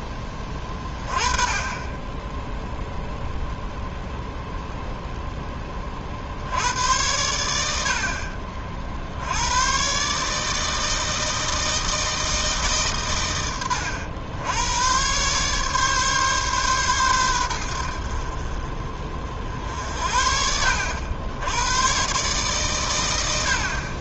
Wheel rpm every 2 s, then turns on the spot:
20, 0, 0, 90, 50, 160, 140, 110, 130, 40, 70, 110.
none